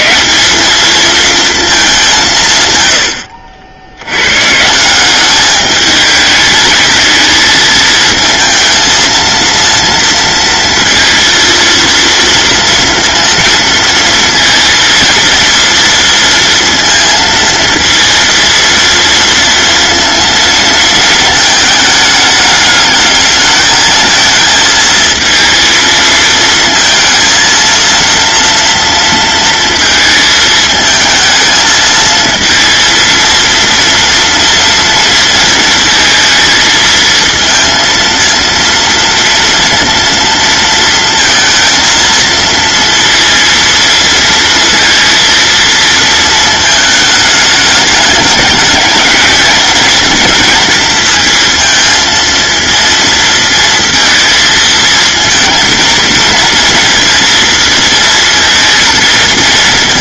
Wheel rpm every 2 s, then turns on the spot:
220, 110, 170, 220, 220, 230, 230, 230, 230, 230, 230, 210, 230, 220, 230, 220, 230, 230, 230, 230, 230, 230, 230, 220, 210, 220, 230, 220, 230, 230.
none